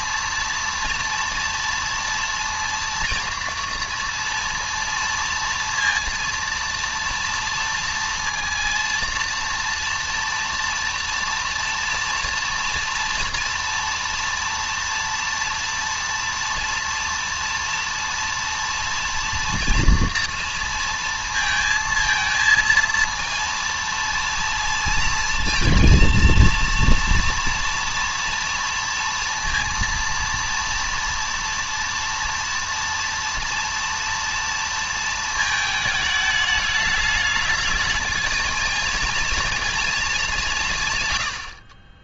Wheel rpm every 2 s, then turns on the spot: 230, 230, 230, 230, 230, 230, 230, 230, 230, 230, 230, 230, 230, 230, 230, 230, 230, 230, 210, 220, 170.
none